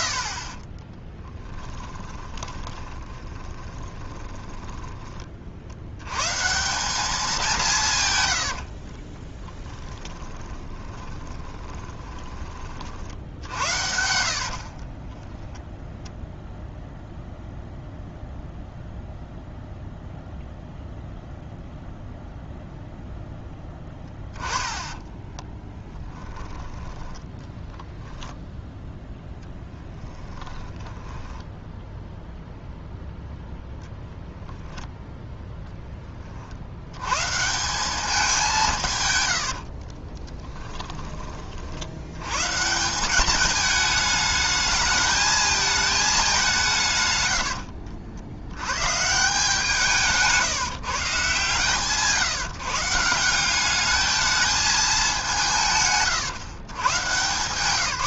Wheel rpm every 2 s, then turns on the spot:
50, 20, 20, 180, 60, 20, 40, 40, 0, 0, 0, 0, 10, 10, 10, 10, 0, 0, 90, 150, 10, 170, 220, 150, 140, 160, 160, 210, 120.
2-6 8-12 14-16 24-26 30-32 40-42